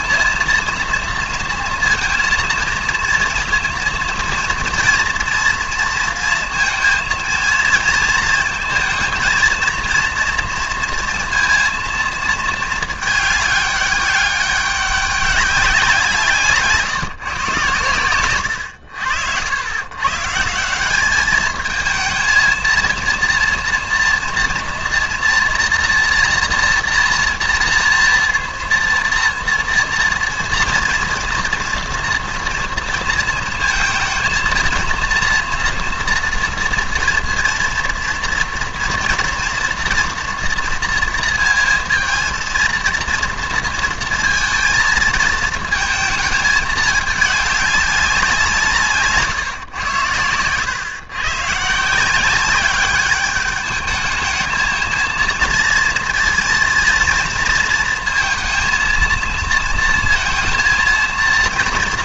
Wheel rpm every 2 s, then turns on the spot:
230, 230, 230, 230, 230, 230, 220, 200, 150, 90, 170, 230, 230, 230, 230, 230, 230, 230, 240, 230, 230, 230, 220, 220, 160, 120, 200, 220, 230, 230, 230.
none